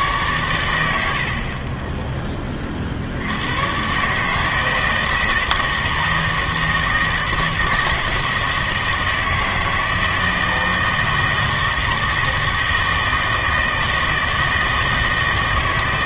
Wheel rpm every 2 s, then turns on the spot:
120, 30, 160, 160, 160, 160, 160, 160.
none